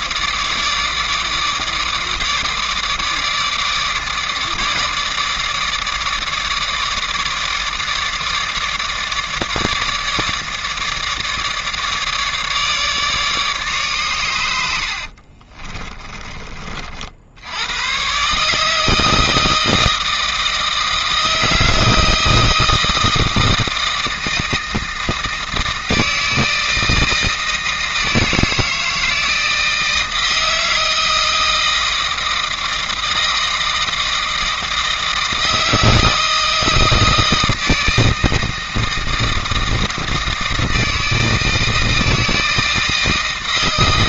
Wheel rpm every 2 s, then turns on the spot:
150, 150, 150, 150, 150, 150, 150, 80, 40, 150, 160, 160, 160, 160, 160, 160, 170, 160, 160, 160, 160, 160.
none